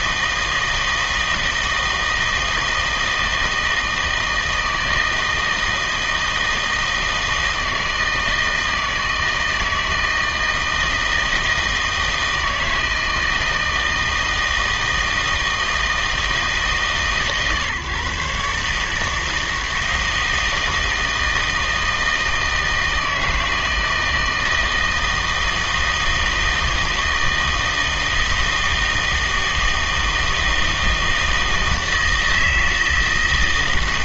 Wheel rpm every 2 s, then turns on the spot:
160, 160, 160, 160, 160, 160, 160, 160, 150, 150, 160, 160, 160, 160, 160, 160, 160.
none